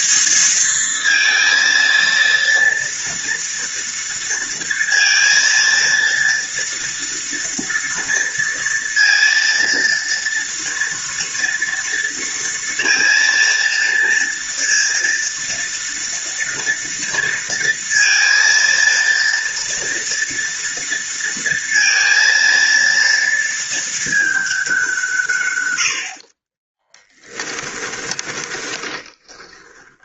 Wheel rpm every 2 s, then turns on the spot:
230, 230, 230, 230, 230, 230, 230, 230, 230, 230, 230, 230, 150, 10, 20.
26-30